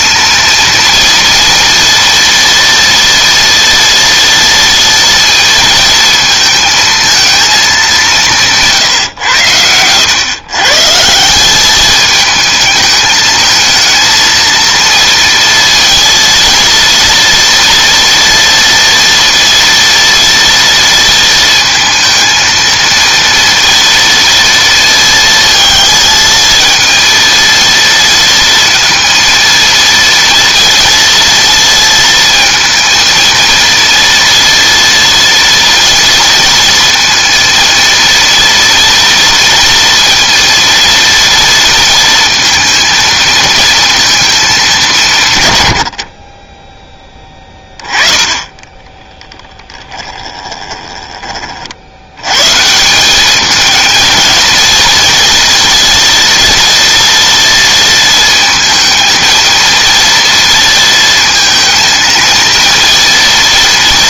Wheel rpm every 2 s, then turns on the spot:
230, 240, 230, 220, 160, 140, 220, 230, 230, 240, 230, 230, 230, 230, 230, 230, 230, 230, 230, 230, 230, 230, 190, 20, 20, 20, 150, 230, 230, 230, 230, 230.
48-52